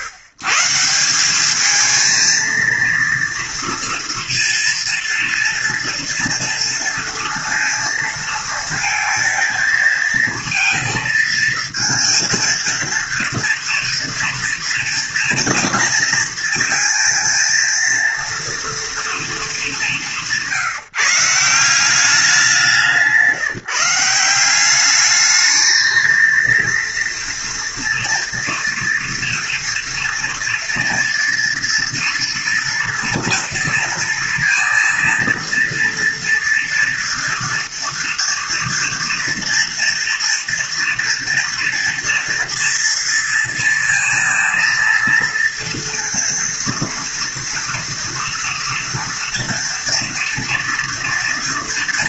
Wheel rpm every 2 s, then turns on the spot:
130, 230, 230, 230, 230, 230, 230, 230, 230, 230, 170, 180, 180, 230, 230, 230, 230, 230, 230, 230, 230, 230, 230, 230, 230, 230.
none